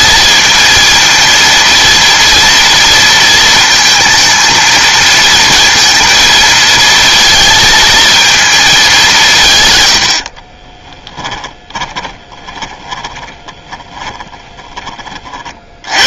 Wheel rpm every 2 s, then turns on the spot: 230, 230, 230, 230, 210, 20, 20, 30.
10-16